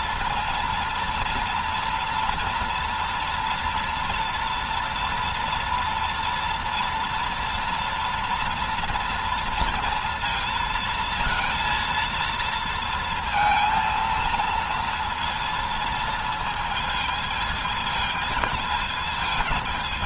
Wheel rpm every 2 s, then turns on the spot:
230, 230, 230, 240, 230, 230, 230, 230, 230, 220.
none